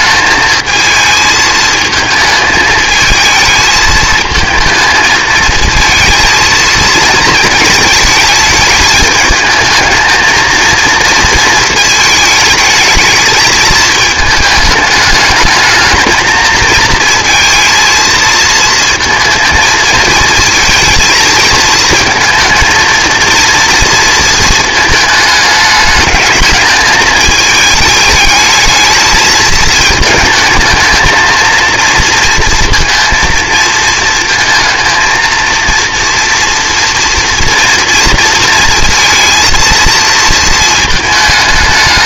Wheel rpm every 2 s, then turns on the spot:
220, 220, 220, 230, 210, 230, 220, 210, 220, 220, 220, 220, 220, 210, 210, 220, 230, 230, 230, 230, 230.
none